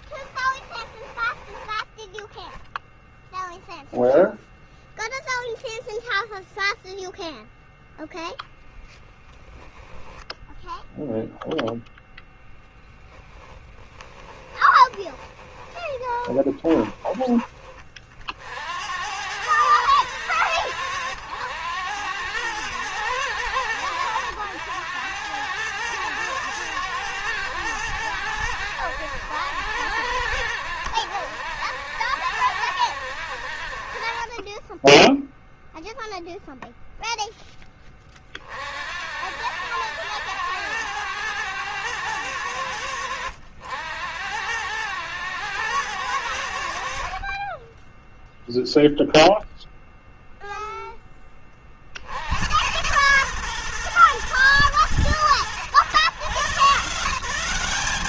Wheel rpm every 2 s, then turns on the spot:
10, 0, 0, 0, 0, 0, 0, 20, 20, 70, 100, 110, 100, 110, 100, 80, 80, 20, 0, 50, 100, 90, 100, 70, 0, 10, 100, 110, 150.
0-2 14-18